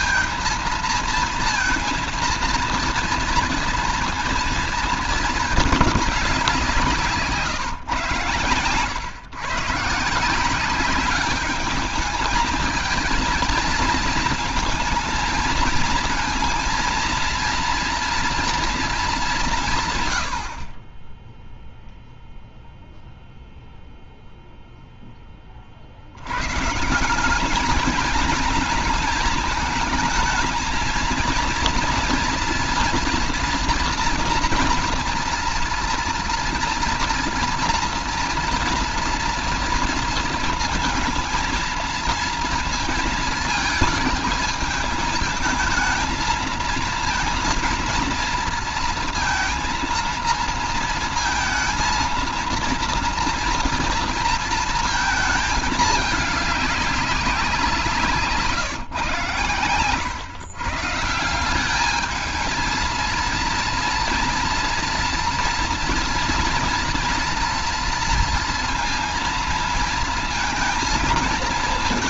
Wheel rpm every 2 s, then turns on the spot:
230, 230, 230, 200, 120, 170, 220, 230, 230, 230, 80, 0, 0, 100, 220, 220, 240, 230, 230, 240, 230, 230, 220, 220, 230, 230, 230, 230, 210, 160, 130, 220, 230, 230, 230, 230.
none